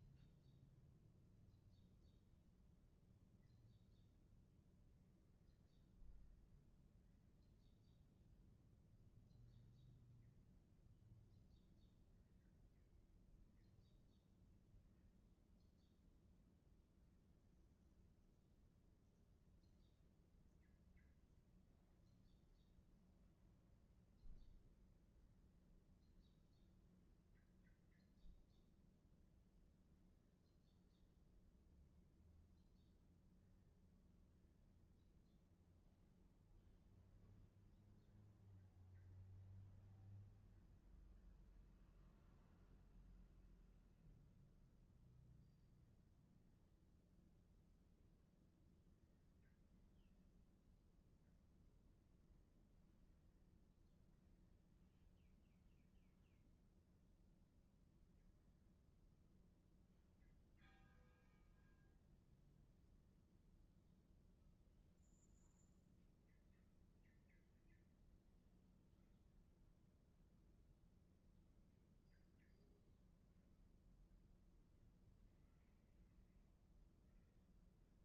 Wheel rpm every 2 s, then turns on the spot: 0, 0, 0, 0, 0, 0, 0, 0, 0, 0, 0, 0, 0, 0, 0, 0, 0, 0, 0, 0, 0, 0, 0, 0, 0, 0, 0, 0, 0, 0, 0, 0, 0, 0, 0, 0, 0, 0, 0.
none